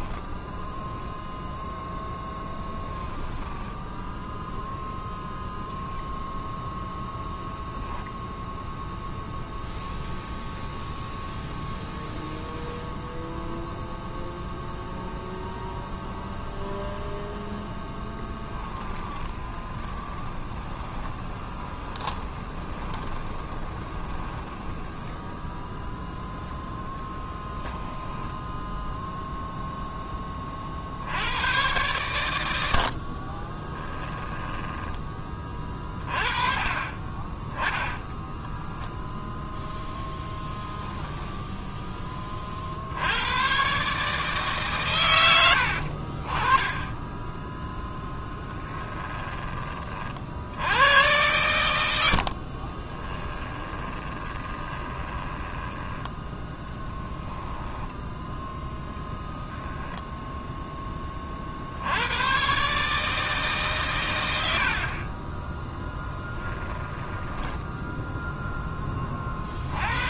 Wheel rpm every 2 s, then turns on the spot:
0, 10, 0, 0, 0, 0, 0, 0, 0, 20, 20, 20, 10, 10, 0, 70, 40, 10, 30, 0, 10, 70, 120, 20, 10, 100, 20, 20, 10, 10, 10, 150, 40, 10, 20.
2-4 18-26 32-34 52-58 66-68